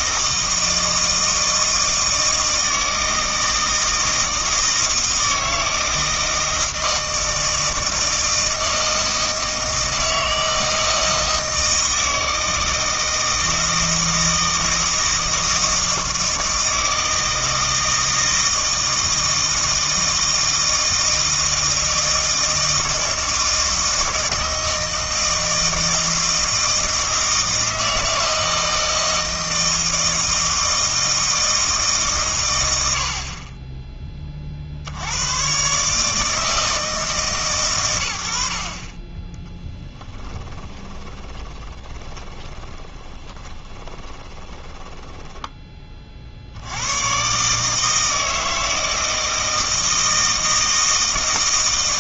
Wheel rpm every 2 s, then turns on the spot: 160, 160, 160, 160, 160, 160, 160, 160, 160, 160, 160, 160, 160, 160, 160, 160, 100, 50, 160, 60, 20, 20, 20, 80, 160, 160.
40-46